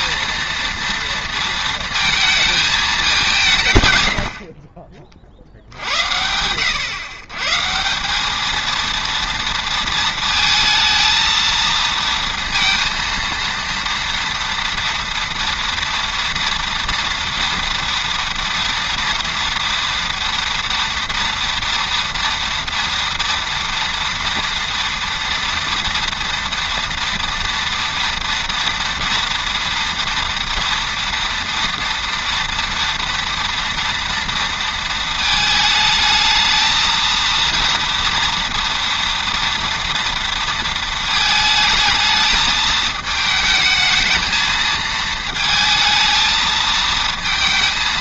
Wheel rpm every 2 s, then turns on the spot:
230, 220, 40, 110, 220, 230, 230, 230, 230, 240, 230, 230, 230, 230, 240, 230, 230, 230, 220, 230, 230, 220, 220, 220.
none